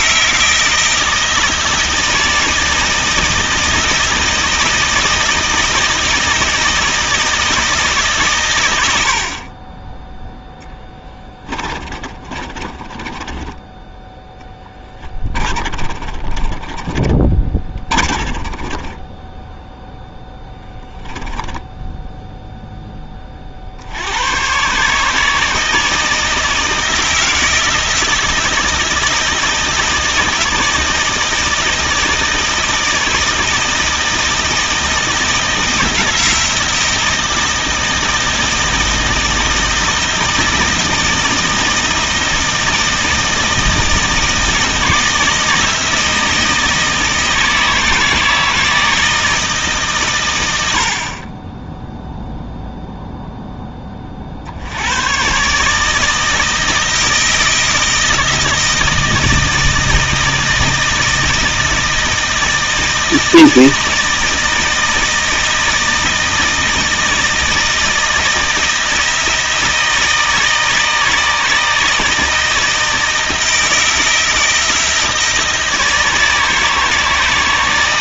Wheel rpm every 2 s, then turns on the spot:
160, 160, 160, 160, 80, 20, 30, 20, 20, 20, 10, 10, 140, 160, 160, 160, 160, 160, 160, 160, 160, 160, 160, 160, 160, 60, 0, 100, 160, 160, 160, 160, 160, 160, 160, 160, 160, 160, 160.
10-22